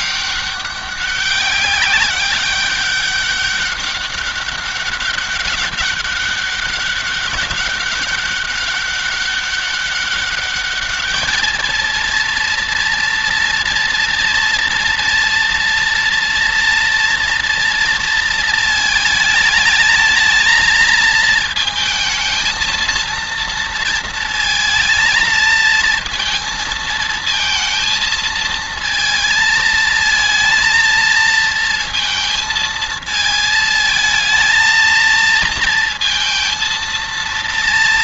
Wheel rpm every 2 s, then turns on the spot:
200, 200, 200, 200, 200, 210, 230, 230, 230, 220, 220, 230, 220, 230, 220, 230, 220, 230, 230.
none